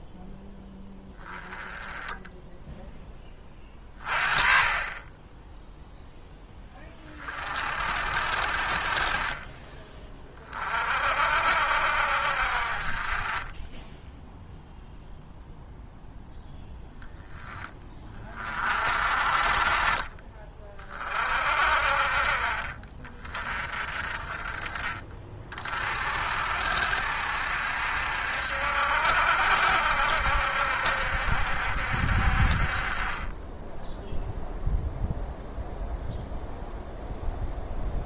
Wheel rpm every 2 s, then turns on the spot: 10, 10, 30, 10, 40, 30, 50, 0, 0, 30, 30, 50, 30, 60, 70, 70, 40, 0, 0.
none